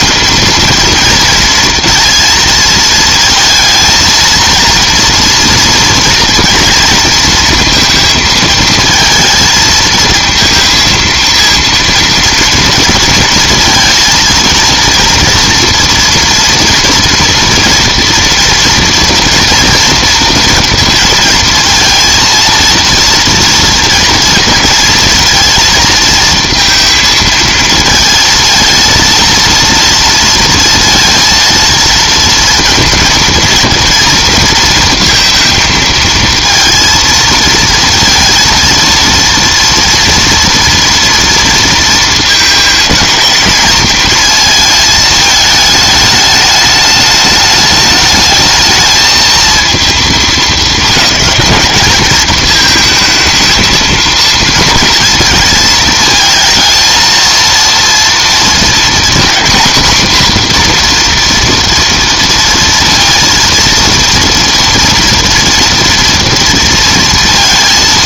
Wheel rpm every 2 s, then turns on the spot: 230, 230, 230, 230, 230, 230, 230, 230, 230, 230, 230, 230, 230, 230, 230, 230, 230, 230, 230, 230, 240, 230, 220, 210, 220, 220, 220, 220, 230, 240, 250, 230, 230, 230.
none